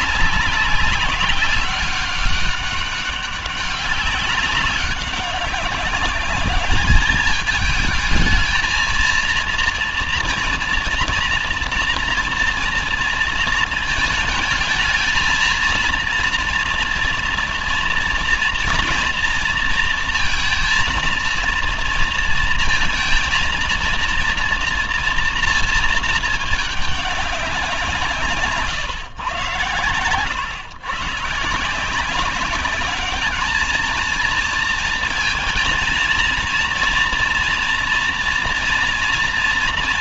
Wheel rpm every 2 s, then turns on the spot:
200, 200, 190, 200, 220, 230, 230, 220, 230, 230, 230, 230, 240, 220, 150, 100, 200, 230, 230, 230.
28-30